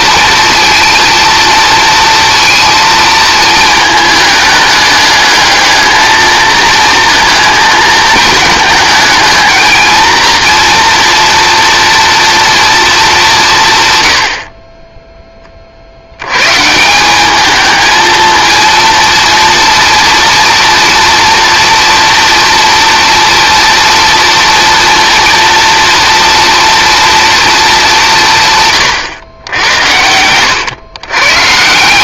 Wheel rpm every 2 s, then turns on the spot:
230, 230, 210, 220, 220, 230, 220, 10, 180, 230, 230, 230, 230, 240, 140, 120.
none